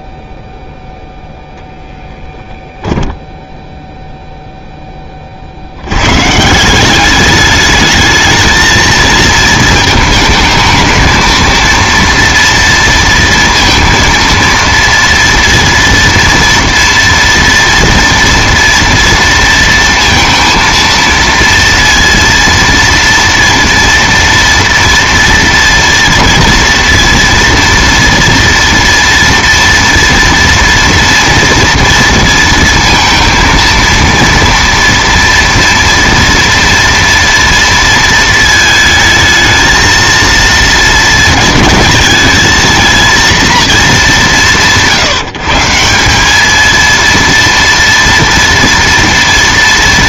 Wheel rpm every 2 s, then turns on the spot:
0, 10, 20, 190, 220, 220, 230, 230, 230, 230, 230, 230, 230, 240, 230, 230, 230, 230, 230, 220, 220, 220, 170, 230, 230.
none